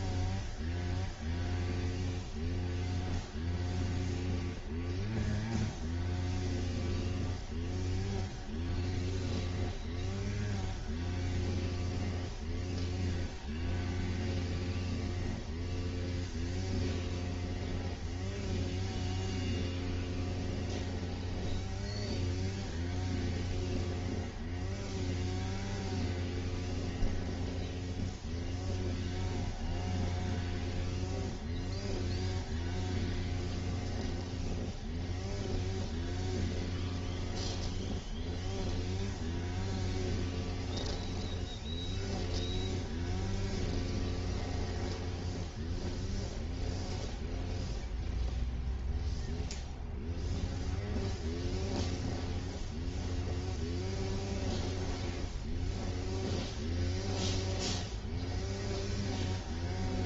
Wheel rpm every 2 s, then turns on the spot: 0, 0, 0, 0, 0, 0, 0, 0, 0, 0, 0, 0, 0, 0, 0, 0, 0, 0, 0, 0, 0, 0, 0, 0, 0, 0, 0, 0, 0, 0.
none